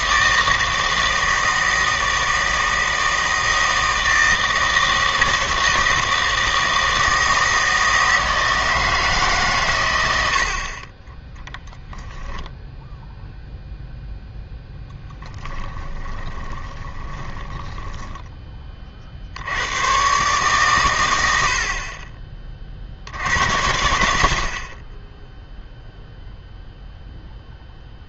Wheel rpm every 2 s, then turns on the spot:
160, 160, 160, 160, 160, 40, 0, 0, 20, 30, 120, 40, 40, 0.
16-18